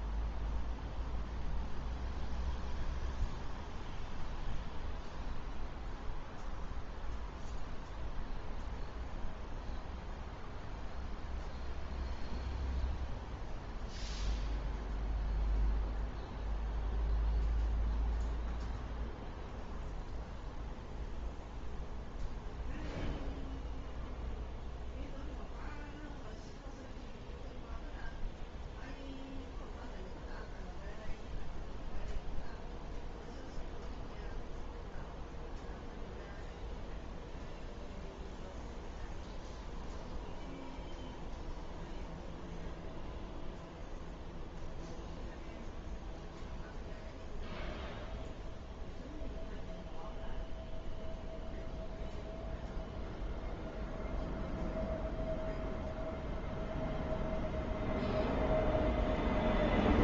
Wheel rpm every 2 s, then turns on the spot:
0, 0, 0, 0, 0, 0, 0, 0, 0, 0, 0, 0, 0, 0, 0, 0, 0, 0, 0, 0, 0, 0, 0, 0, 0, 0, 0, 0, 0, 0.
none